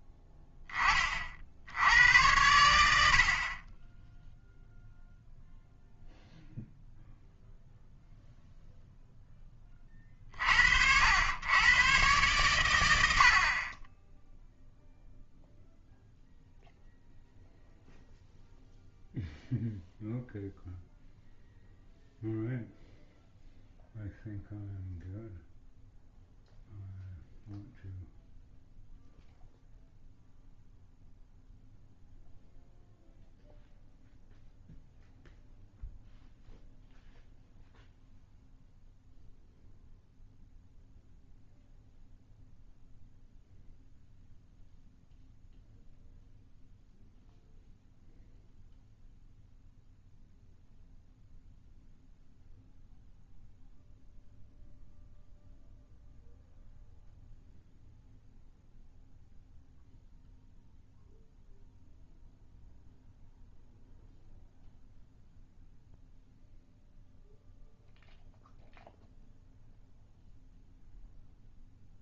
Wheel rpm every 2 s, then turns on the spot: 20, 90, 0, 0, 0, 60, 110, 0, 0, 0, 0, 0, 0, 0, 0, 0, 0, 0, 0, 0, 0, 0, 0, 0, 0, 0, 0, 0, 0, 0, 0, 0, 0, 0, 0, 0.
none